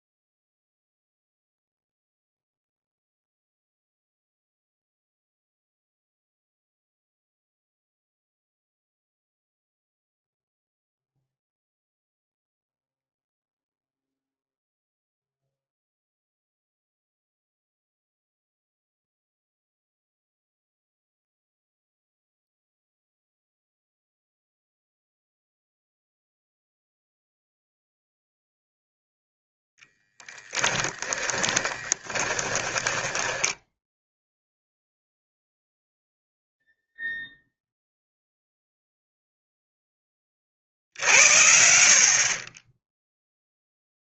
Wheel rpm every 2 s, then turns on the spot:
0, 0, 0, 0, 0, 0, 0, 0, 0, 0, 0, 0, 0, 0, 0, 10, 10, 0, 0, 0, 50, 10.
30-34